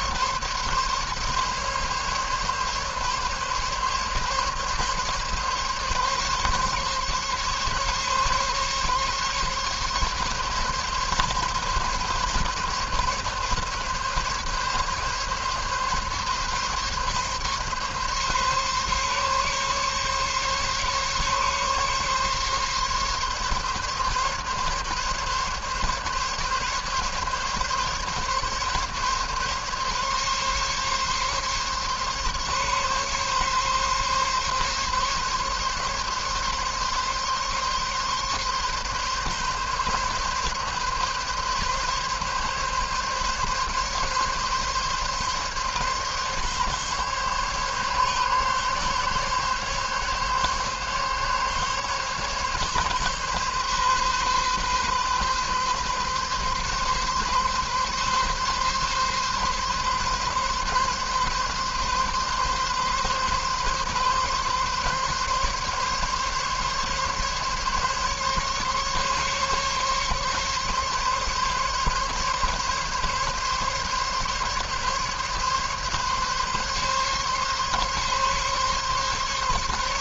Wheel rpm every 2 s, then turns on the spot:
140, 140, 140, 140, 140, 140, 140, 140, 140, 140, 140, 140, 140, 140, 140, 140, 140, 140, 140, 140, 140, 140, 140, 140, 140, 140, 140, 130, 140, 140, 130, 140, 140, 140, 140, 140, 140, 140, 140, 140.
none